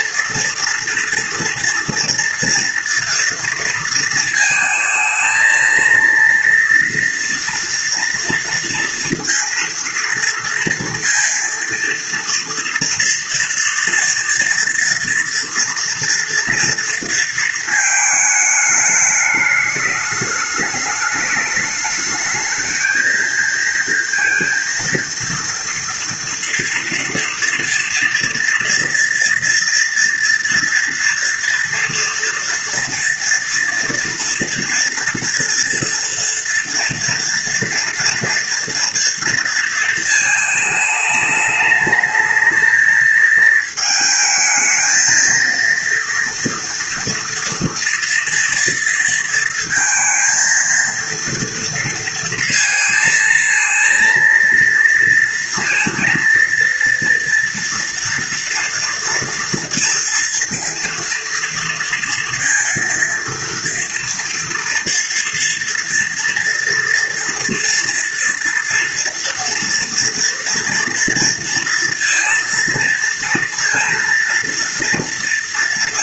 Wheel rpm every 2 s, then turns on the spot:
230, 230, 230, 230, 230, 230, 230, 240, 230, 210, 210, 220, 230, 240, 240, 230, 230, 230, 230, 230, 220, 220, 220, 230, 230, 230, 230, 230, 230, 230, 230, 230, 230, 230, 240, 230, 230, 230.
none